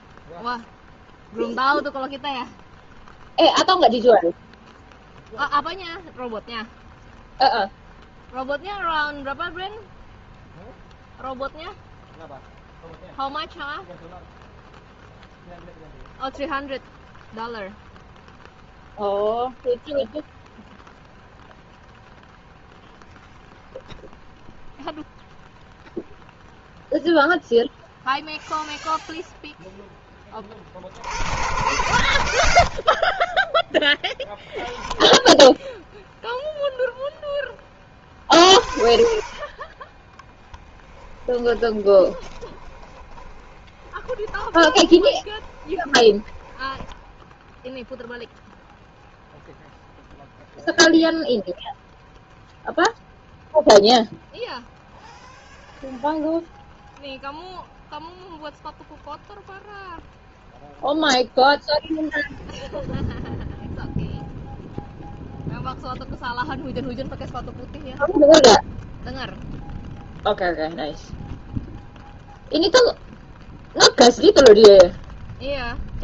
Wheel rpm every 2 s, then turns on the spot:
0, 0, 0, 0, 0, 0, 0, 0, 0, 0, 0, 0, 0, 0, 0, 50, 60, 0, 0, 40, 10, 20, 20, 10, 0, 0, 0, 0, 0, 0, 0, 0, 0, 0, 0, 0, 0, 0.
40-48